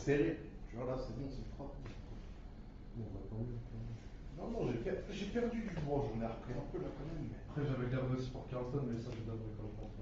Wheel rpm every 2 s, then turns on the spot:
0, 0, 0, 0, 0.
none